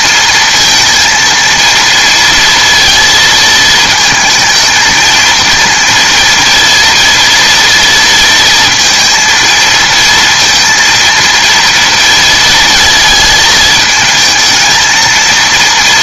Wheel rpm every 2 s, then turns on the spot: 230, 230, 220, 240, 230, 230, 230, 220.
none